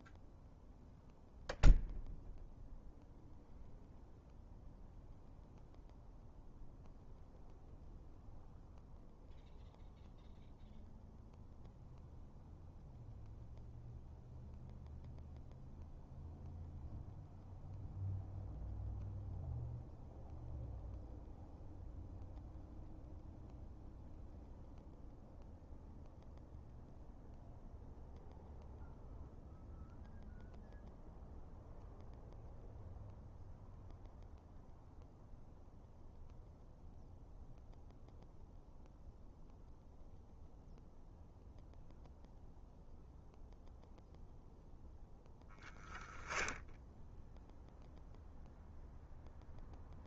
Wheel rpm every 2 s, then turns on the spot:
0, 0, 0, 0, 0, 0, 0, 0, 0, 0, 0, 0, 0, 0, 0, 0, 0, 0, 0, 0, 0, 0, 0, 0, 0.
none